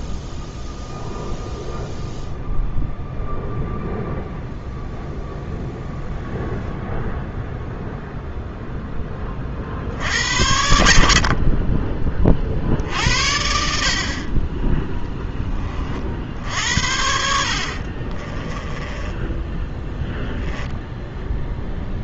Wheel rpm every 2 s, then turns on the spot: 0, 0, 0, 0, 10, 70, 60, 10, 70, 10, 0.
18-20